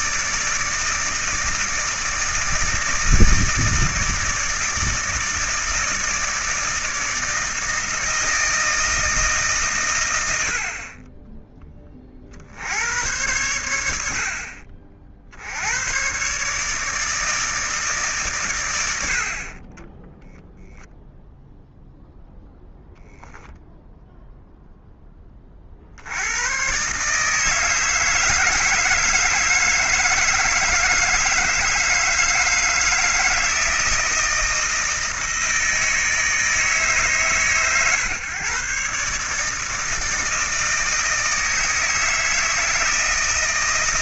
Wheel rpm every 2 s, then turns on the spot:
160, 160, 160, 160, 160, 60, 80, 50, 150, 100, 0, 0, 0, 130, 160, 160, 160, 160, 150, 130, 160, 160.
none